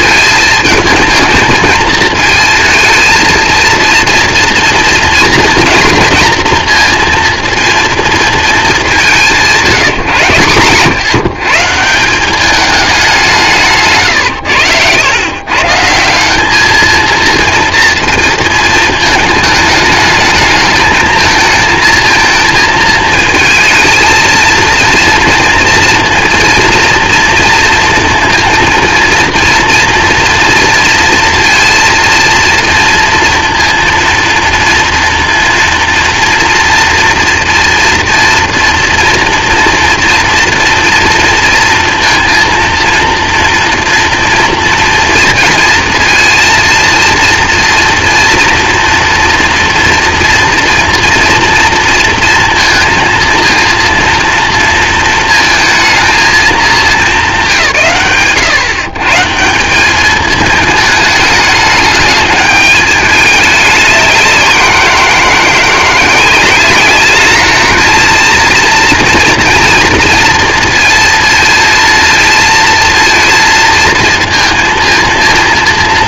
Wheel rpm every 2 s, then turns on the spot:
230, 220, 240, 240, 180, 140, 200, 100, 230, 220, 220, 220, 230, 230, 230, 230, 240, 230, 230, 230, 230, 230, 230, 230, 230, 230, 230, 230, 210, 150, 210, 210, 170, 210, 230, 230, 230, 230.
none